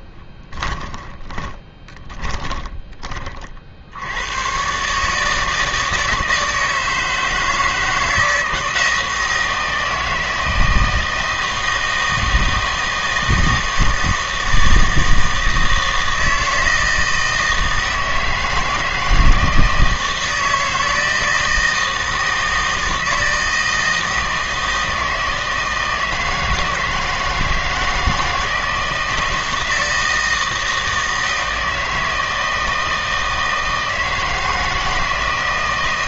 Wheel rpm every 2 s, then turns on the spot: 10, 30, 130, 160, 160, 160, 160, 160, 160, 160, 160, 160, 160, 160, 160, 160, 160, 160.
0-4